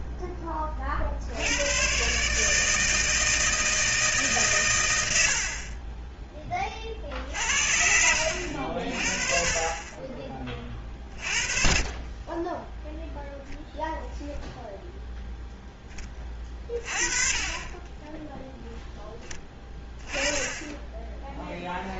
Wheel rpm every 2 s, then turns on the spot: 30, 160, 110, 50, 50, 30, 0, 0, 30, 0, 10.
10-12